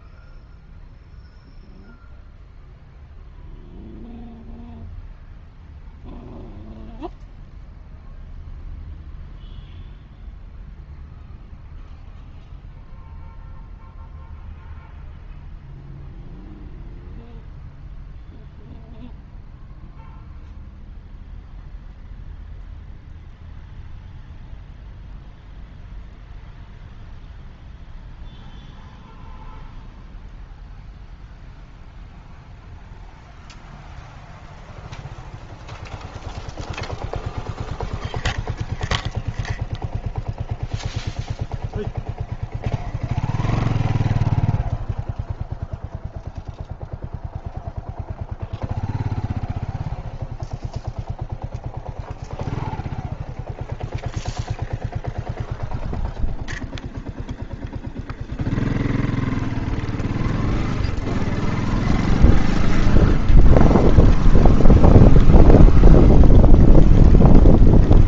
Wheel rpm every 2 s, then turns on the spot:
0, 0, 0, 0, 0, 0, 0, 0, 0, 0, 0, 0, 0, 0, 0, 0, 0, 0, 0, 0, 0, 0, 0, 0, 0, 0, 0, 0, 0, 0, 0, 0, 0, 0.
none